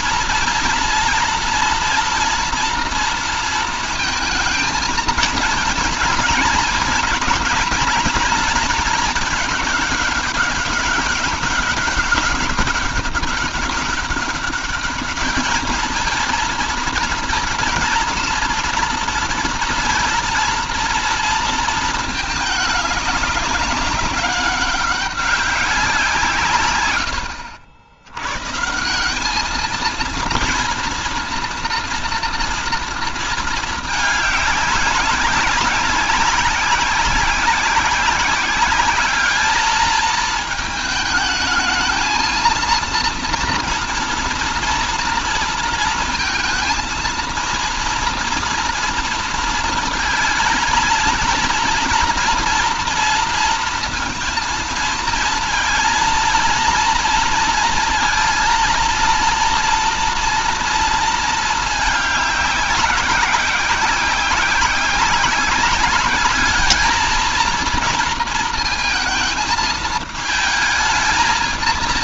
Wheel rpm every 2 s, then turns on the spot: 230, 240, 220, 230, 220, 200, 200, 210, 230, 230, 230, 210, 190, 110, 160, 230, 230, 200, 200, 210, 220, 230, 230, 230, 230, 230, 230, 230, 230, 230, 230, 200, 190, 220, 220, 220.
none